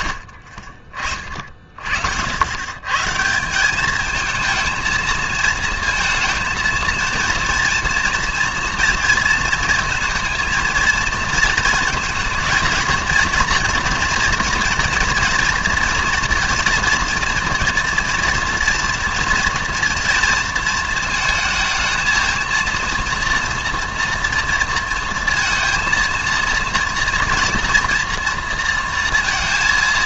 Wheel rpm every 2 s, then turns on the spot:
50, 100, 220, 230, 230, 230, 230, 230, 240, 230, 230, 230, 230, 230, 230.
none